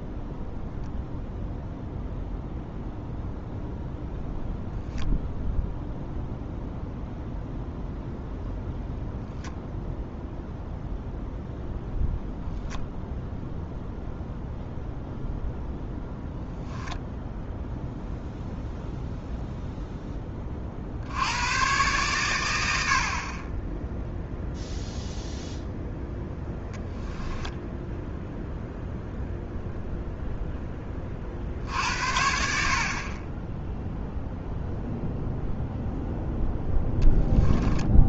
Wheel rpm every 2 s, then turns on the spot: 0, 0, 0, 0, 0, 0, 0, 0, 0, 0, 60, 70, 0, 10, 0, 10, 60, 0, 0.
26-28